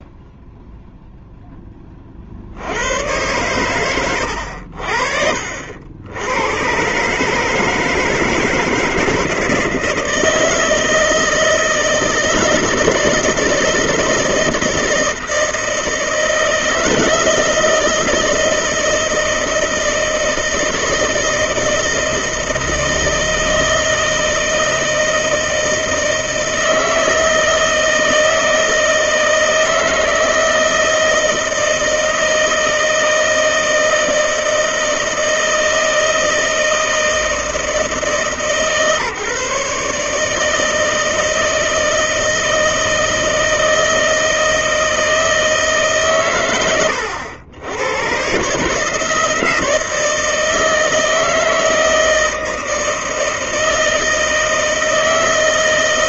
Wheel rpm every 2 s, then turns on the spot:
0, 70, 80, 120, 160, 160, 160, 160, 160, 160, 160, 160, 160, 160, 160, 160, 160, 160, 160, 150, 160, 160, 160, 110, 150, 160, 160, 160.
none